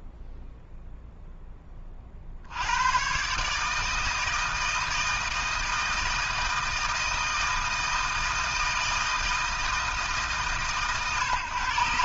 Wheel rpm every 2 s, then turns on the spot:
0, 120, 160, 160, 160, 130.
none